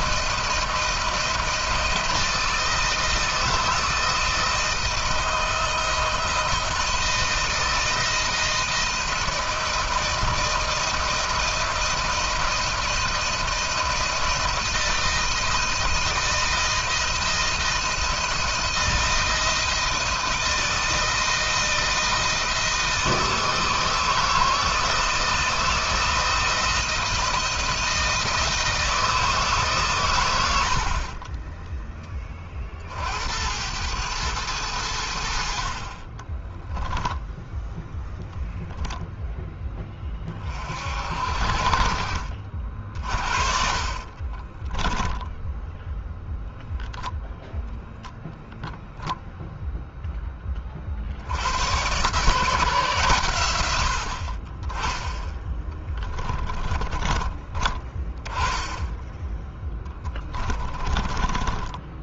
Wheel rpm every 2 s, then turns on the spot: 170, 160, 160, 160, 160, 160, 160, 160, 170, 170, 160, 160, 160, 170, 160, 70, 40, 90, 10, 0, 50, 50, 20, 0, 0, 40, 140, 20, 20, 10, 20.
36-38 44-46 56-58 60-62